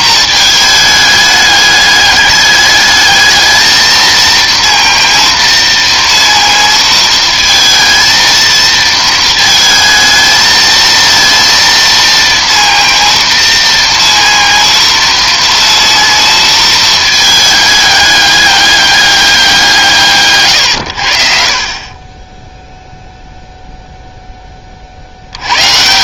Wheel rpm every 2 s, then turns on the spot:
220, 210, 230, 230, 230, 220, 230, 230, 230, 200, 120, 0, 30.
none